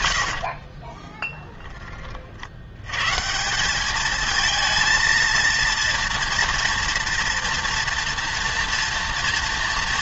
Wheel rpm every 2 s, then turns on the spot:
60, 80, 220, 230, 230.
0-2